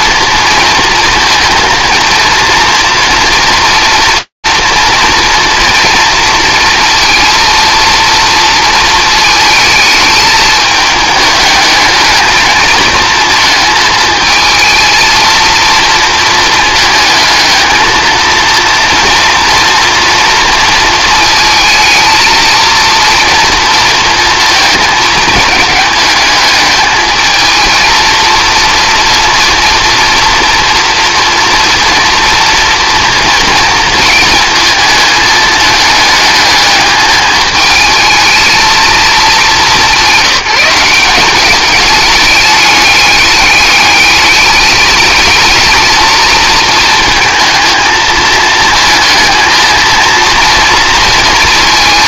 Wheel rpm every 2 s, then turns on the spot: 230, 230, 230, 230, 220, 210, 220, 230, 220, 230, 220, 230, 220, 220, 230, 230, 230, 220, 220, 220, 190, 210, 210, 230, 220, 230.
none